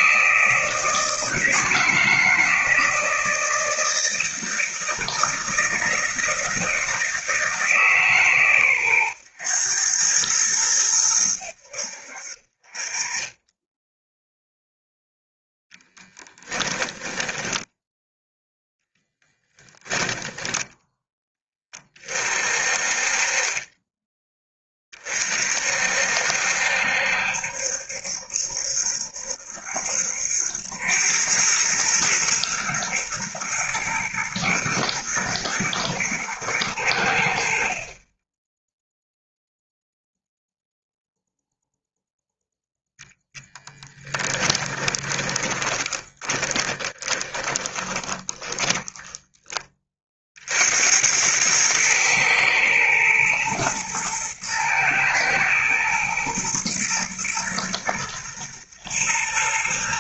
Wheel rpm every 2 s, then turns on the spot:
160, 160, 160, 160, 130, 100, 30, 0, 10, 10, 10, 40, 30, 70, 70, 90, 110, 120, 90, 0, 0, 0, 20, 20, 20, 80, 110, 110, 120, 110.
16-18 44-50